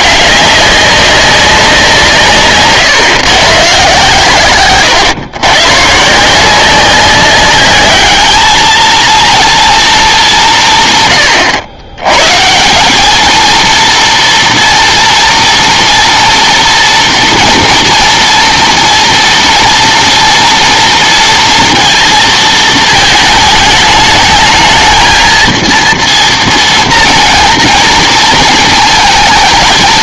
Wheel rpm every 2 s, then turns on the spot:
200, 140, 120, 180, 220, 160, 170, 240, 240, 240, 230, 220, 210, 230, 230.
2-4